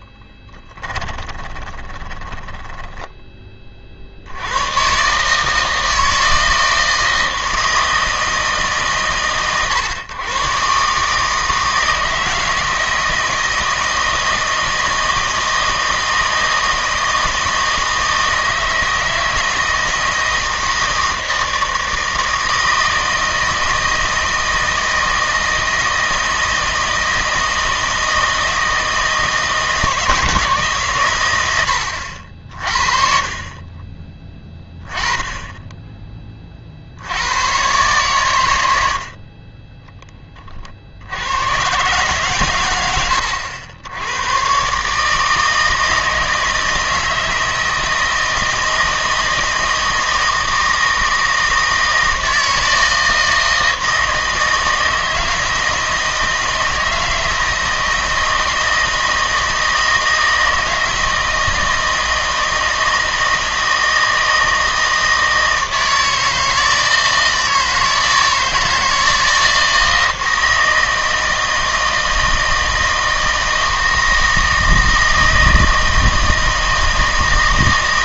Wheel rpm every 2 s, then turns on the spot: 10, 20, 100, 160, 150, 130, 160, 160, 160, 160, 160, 160, 160, 160, 160, 150, 60, 20, 40, 90, 50, 100, 130, 160, 160, 160, 160, 160, 160, 160, 160, 160, 160, 160, 160, 160, 160, 160, 160.
0-4